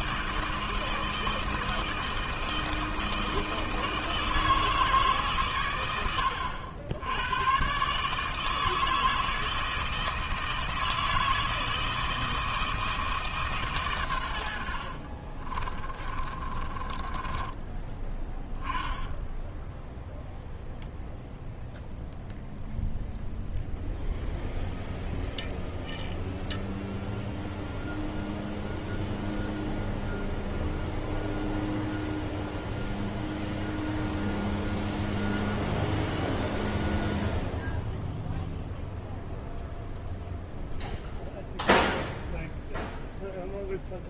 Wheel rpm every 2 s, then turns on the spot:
160, 160, 150, 90, 160, 160, 160, 60, 20, 10, 0, 0, 0, 0, 0, 0, 0, 0, 0, 0, 0, 0.
14-18